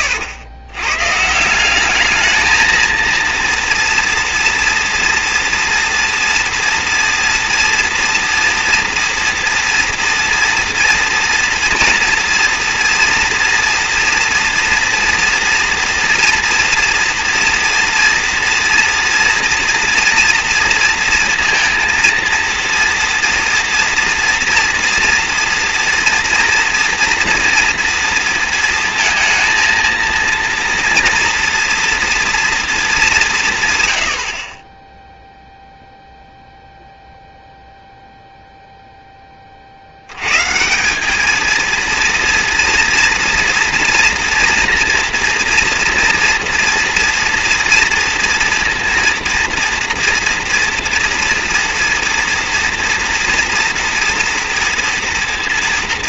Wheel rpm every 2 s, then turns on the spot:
110, 230, 230, 240, 230, 240, 230, 230, 230, 230, 230, 230, 230, 240, 230, 230, 220, 10, 0, 0, 150, 230, 230, 230, 230, 230, 230, 230.
none